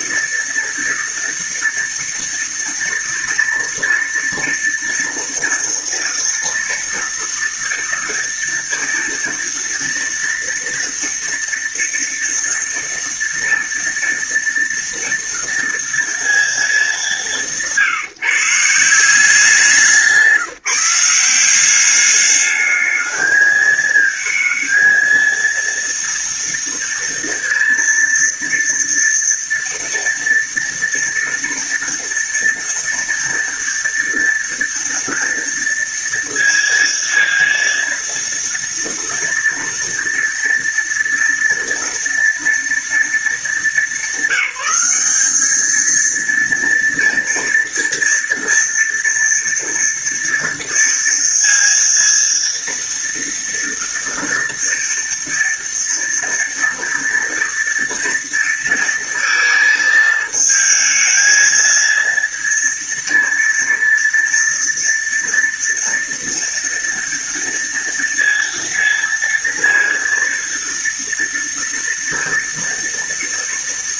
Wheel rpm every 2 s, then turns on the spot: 230, 230, 230, 230, 230, 230, 230, 230, 200, 160, 170, 210, 220, 230, 230, 230, 230, 230, 230, 230, 230, 230, 200, 230, 230, 230, 230, 230, 240, 230, 220, 230, 230, 230, 230, 230, 230.
none